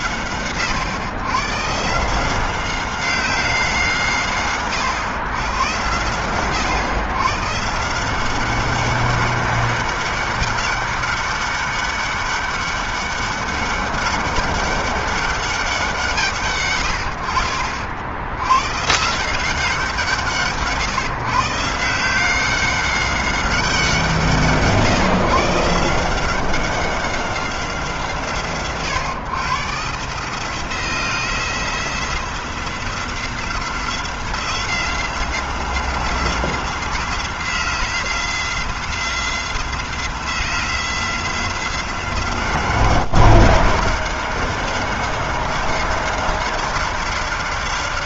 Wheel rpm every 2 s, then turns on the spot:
120, 180, 110, 120, 200, 200, 200, 190, 80, 160, 150, 190, 140, 190, 120, 170, 180, 180, 180, 180, 180, 190, 190, 190.
none